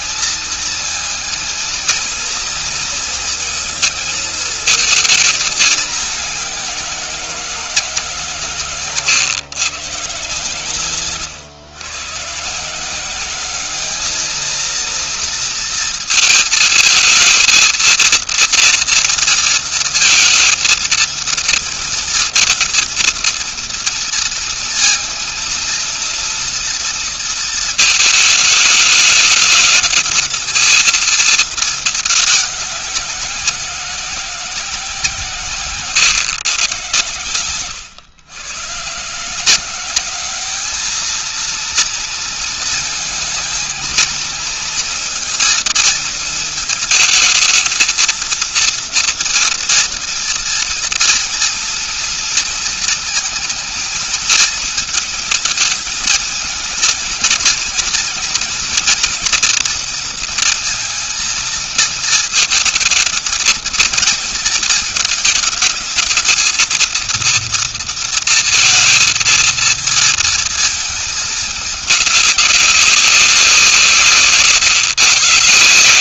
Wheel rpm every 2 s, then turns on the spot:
220, 230, 220, 200, 150, 130, 140, 220, 230, 230, 230, 230, 230, 230, 220, 220, 200, 180, 120, 120, 200, 230, 220, 220, 230, 230, 230, 220, 220, 240, 230, 230, 230, 220, 230, 220, 200, 160.
none